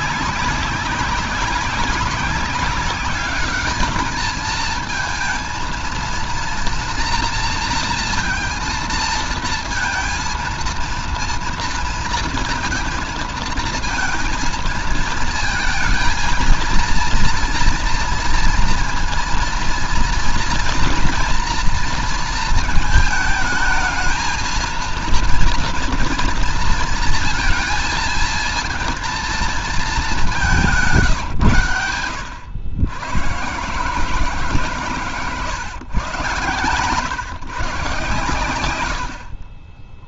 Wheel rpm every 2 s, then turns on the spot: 200, 200, 220, 240, 230, 230, 230, 230, 230, 230, 230, 220, 220, 230, 220, 190, 100, 150, 120, 100.
none